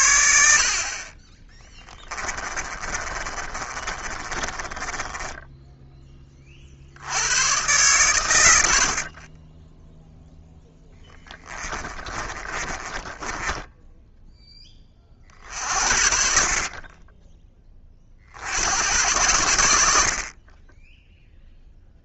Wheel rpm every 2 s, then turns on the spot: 50, 30, 20, 50, 80, 10, 20, 20, 30, 90, 20.
2-6 10-14